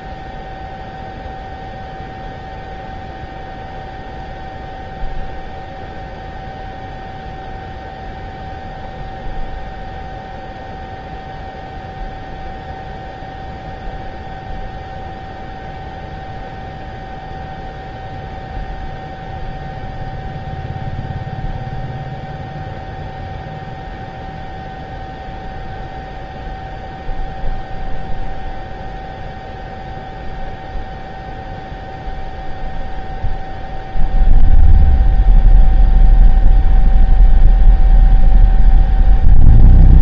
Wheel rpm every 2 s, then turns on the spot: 0, 0, 0, 0, 0, 0, 0, 0, 0, 0, 0, 0, 0, 0, 0, 0, 0, 0, 0, 0.
none